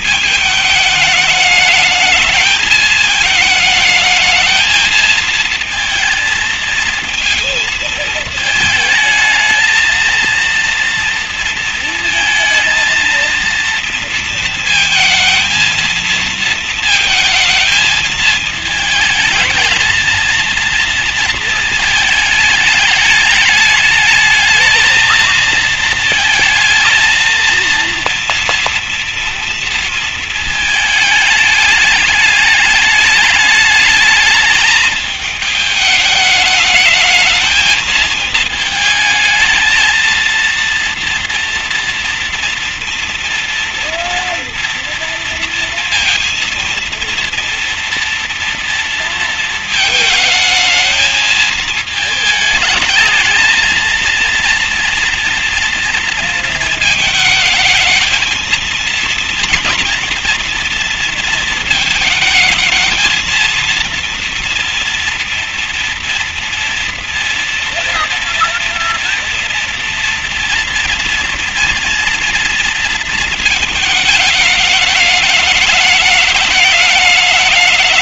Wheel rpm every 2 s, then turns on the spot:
210, 220, 220, 230, 220, 230, 230, 230, 220, 220, 230, 210, 220, 230, 230, 210, 210, 220, 220, 220, 230, 240, 230, 240, 220, 220, 230, 230, 220, 240, 230, 230, 240, 240, 230, 230, 220, 210, 210.
none